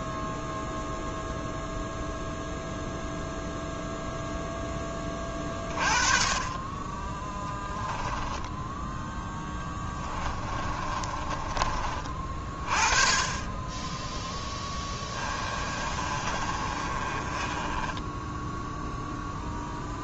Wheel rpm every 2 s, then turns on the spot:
0, 0, 20, 20, 10, 30, 30, 10, 30, 0.
8-12 14-18